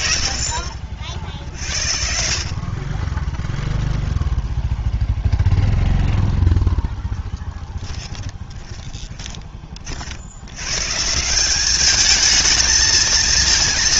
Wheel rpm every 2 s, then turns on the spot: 50, 20, 0, 0, 10, 140, 230.
8-10